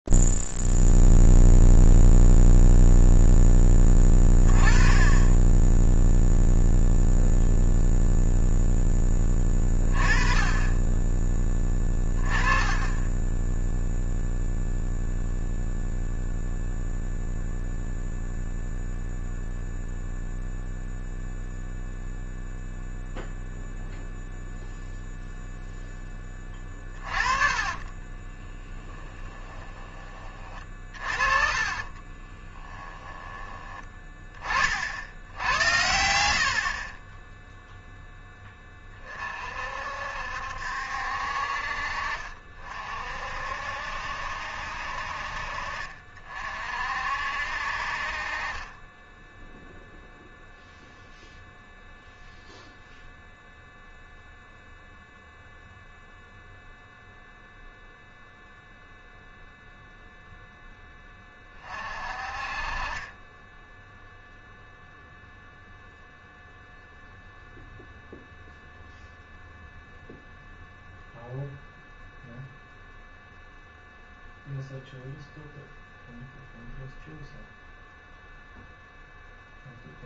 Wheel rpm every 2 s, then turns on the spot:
0, 0, 10, 0, 0, 30, 20, 0, 0, 0, 0, 0, 0, 20, 20, 40, 10, 50, 60, 20, 60, 40, 60, 50, 20, 0, 0, 0, 0, 0, 10, 40, 0, 0, 0, 0, 0, 0, 0, 0.
26-30 32-34